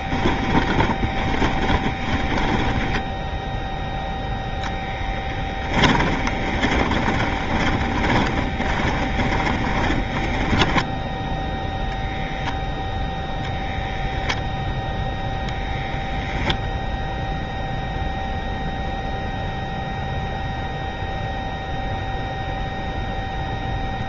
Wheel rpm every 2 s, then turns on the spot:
10, 10, 0, 20, 20, 10, 0, 0, 0, 0, 0, 0.
0-4 6-12